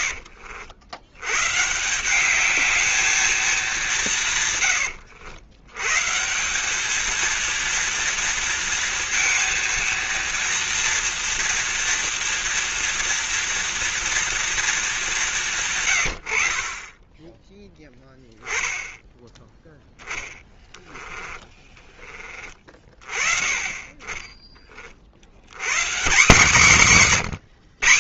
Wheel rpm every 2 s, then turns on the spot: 80, 210, 110, 200, 230, 230, 230, 220, 40, 10, 10, 30, 40, 190.
none